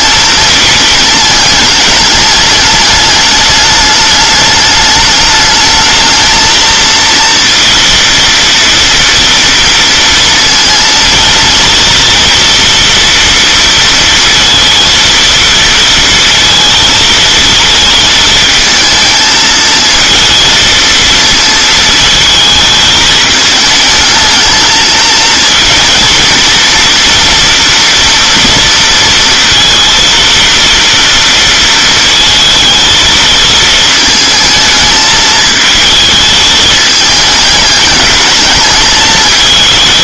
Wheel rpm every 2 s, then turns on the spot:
220, 210, 210, 220, 230, 230, 240, 230, 230, 220, 230, 220, 220, 230, 230, 230, 220, 220, 220, 210.
none